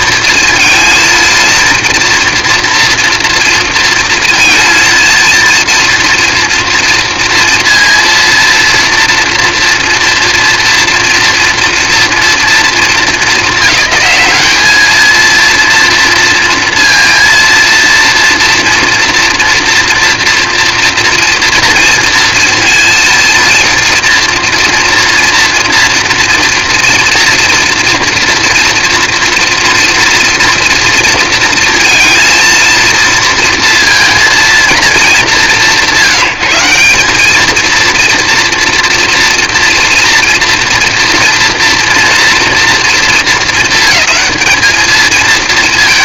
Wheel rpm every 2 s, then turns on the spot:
230, 230, 230, 230, 230, 230, 230, 200, 230, 230, 230, 230, 230, 230, 230, 230, 230, 230, 180, 230, 230, 230, 210.
none